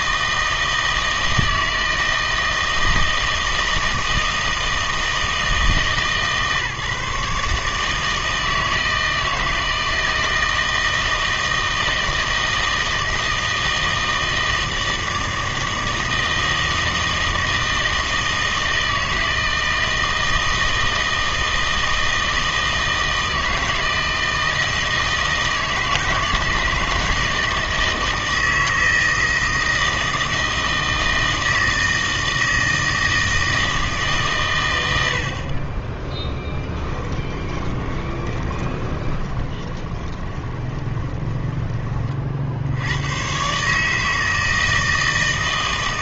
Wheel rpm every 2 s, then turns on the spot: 160, 160, 160, 140, 160, 160, 160, 160, 160, 160, 160, 160, 160, 150, 160, 160, 160, 110, 10, 20, 20, 80, 160.
36-42